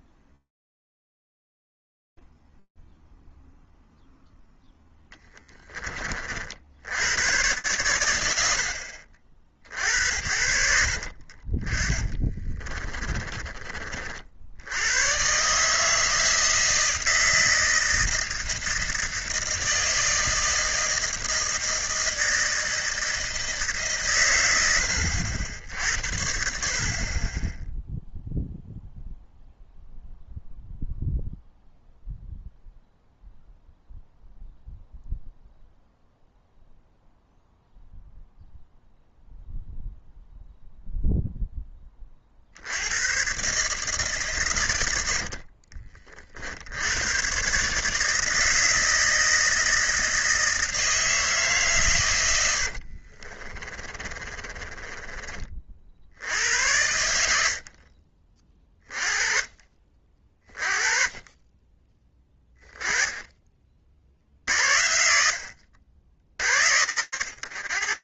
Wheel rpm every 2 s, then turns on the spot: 0, 0, 0, 40, 80, 60, 20, 70, 160, 160, 160, 160, 100, 50, 0, 0, 0, 0, 0, 0, 0, 80, 100, 80, 160, 160, 70, 20, 90, 30, 20, 10, 60, 70.
12-14 44-46 52-56 62-64